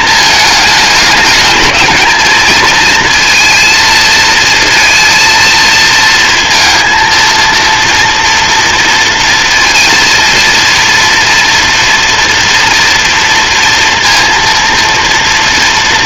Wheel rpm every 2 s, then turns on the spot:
210, 230, 230, 230, 230, 230, 230, 240.
none